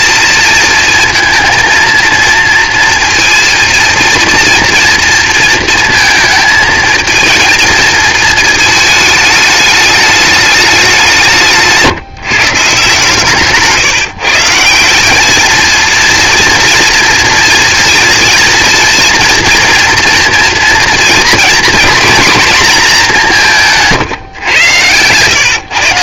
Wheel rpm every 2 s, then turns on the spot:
220, 230, 230, 220, 220, 190, 150, 180, 230, 240, 230, 210, 110.
24-26